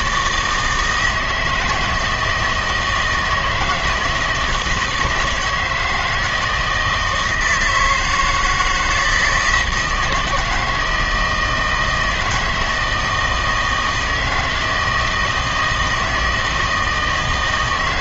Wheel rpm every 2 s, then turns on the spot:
160, 160, 160, 160, 170, 160, 160, 160, 160.
none